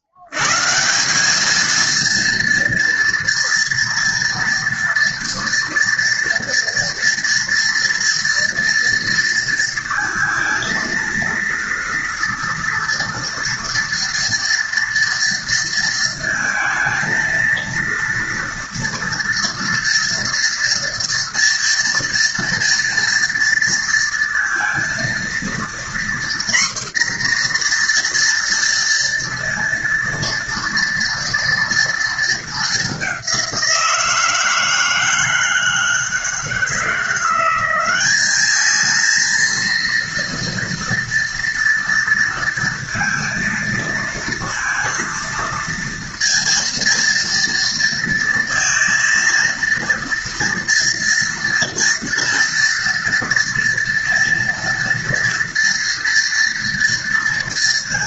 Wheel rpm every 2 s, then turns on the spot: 100, 230, 230, 230, 230, 230, 230, 230, 230, 230, 230, 240, 230, 240, 230, 230, 220, 160, 160, 210, 230, 230, 230, 230, 230, 230, 230, 240, 240.
none